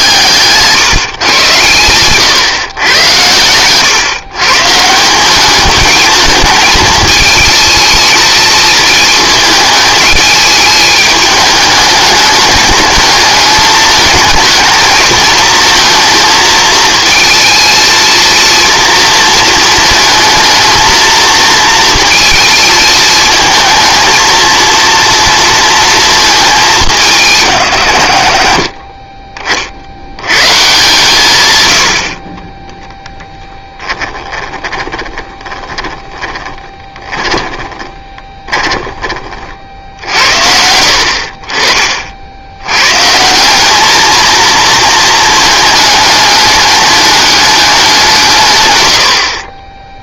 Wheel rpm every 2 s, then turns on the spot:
140, 120, 150, 220, 220, 220, 210, 220, 220, 230, 220, 230, 230, 200, 40, 130, 20, 10, 10, 20, 70, 110, 230, 210, 130.
32-40